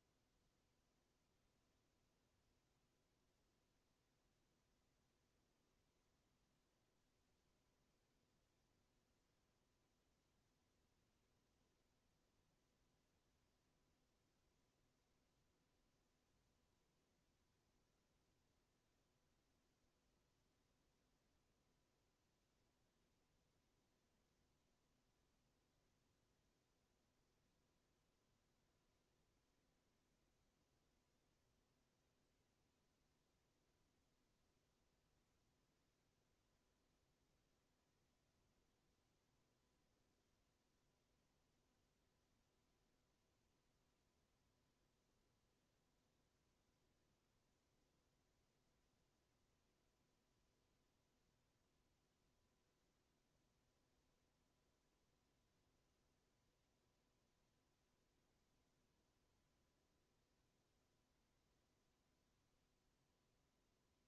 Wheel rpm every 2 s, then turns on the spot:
0, 0, 0, 0, 0, 0, 0, 0, 0, 0, 0, 0, 0, 0, 0, 0, 0, 0, 0, 0, 0, 0, 0, 0, 0, 0, 0, 0, 0, 0, 0, 0.
none